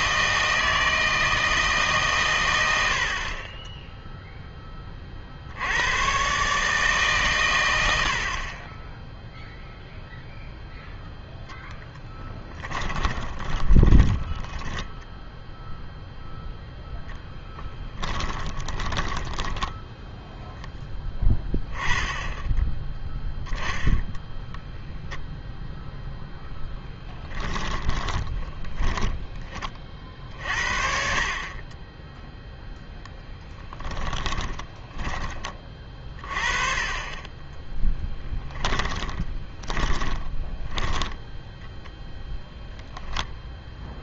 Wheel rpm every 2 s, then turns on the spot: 160, 80, 20, 150, 10, 0, 20, 10, 0, 20, 10, 10, 0, 10, 10, 60, 0, 20, 30, 10, 10, 0.
12-16 18-20 28-30 34-36 38-42